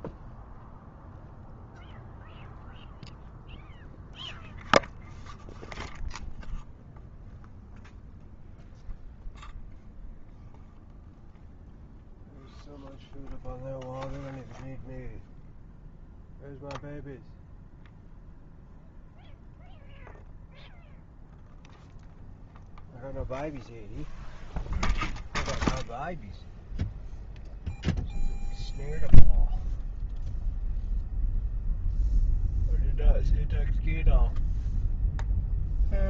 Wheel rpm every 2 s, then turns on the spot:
0, 0, 0, 0, 0, 0, 0, 0, 0, 0, 0, 0, 0, 0, 0, 0, 0, 0.
none